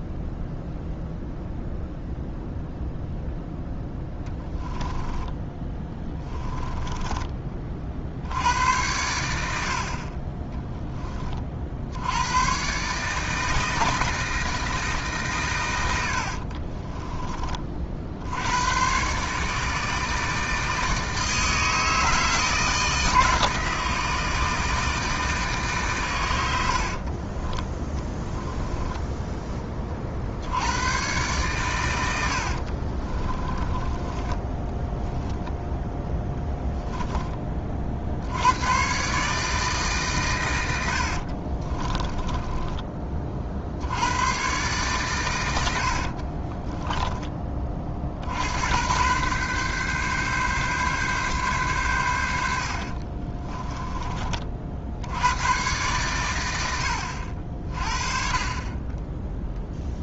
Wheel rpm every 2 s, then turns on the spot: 0, 0, 10, 20, 80, 10, 130, 150, 30, 110, 160, 160, 160, 60, 10, 110, 40, 10, 10, 120, 90, 20, 130, 30, 100, 140, 60, 70, 70, 20.
4-8 16-18 26-30 32-36 46-48 52-54